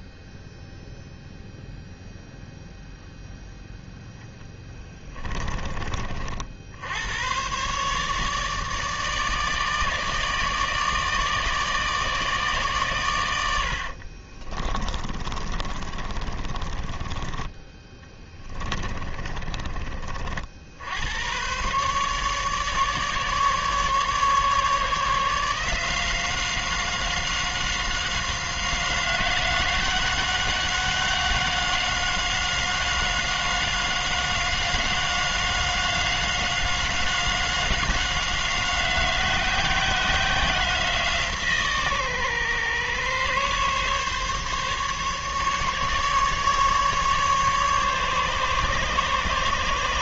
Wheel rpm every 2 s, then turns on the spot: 0, 0, 10, 80, 150, 150, 130, 20, 20, 20, 80, 150, 150, 190, 180, 190, 190, 190, 190, 190, 180, 130, 140, 150, 140.
4-6 14-20